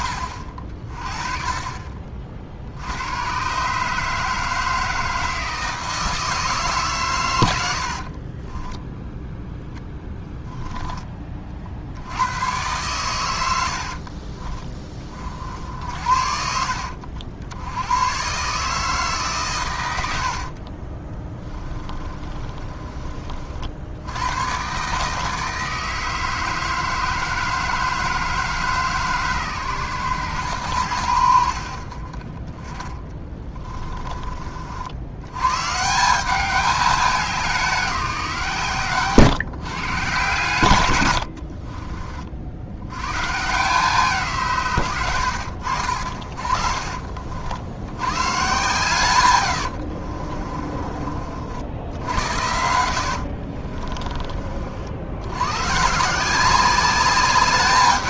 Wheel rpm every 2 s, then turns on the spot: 50, 80, 160, 140, 10, 10, 110, 20, 60, 150, 40, 30, 140, 160, 150, 90, 20, 60, 200, 140, 110, 90, 110, 50, 130, 30, 70, 60, 200.
8-10 20-22 32-34